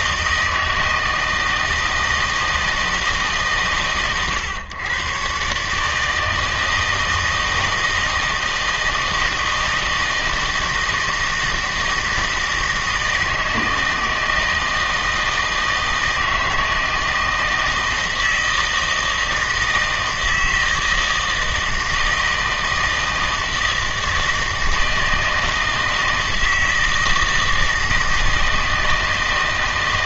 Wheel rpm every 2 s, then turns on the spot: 160, 160, 110, 160, 160, 160, 160, 160, 160, 160, 160, 160, 160, 160, 160.
none